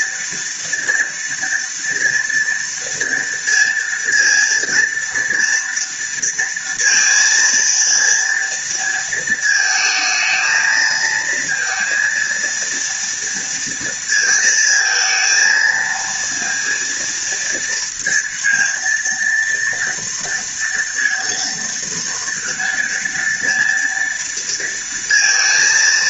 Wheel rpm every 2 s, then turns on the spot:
230, 230, 230, 230, 230, 230, 230, 220, 230, 230, 230, 230, 230.
none